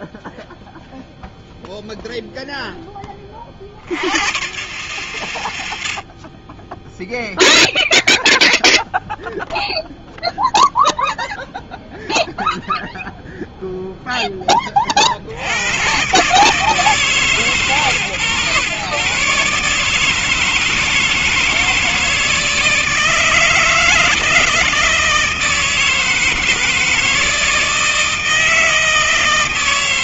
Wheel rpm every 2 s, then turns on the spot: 0, 10, 120, 20, 0, 0, 0, 30, 150, 140, 160, 160, 160, 160, 160.
none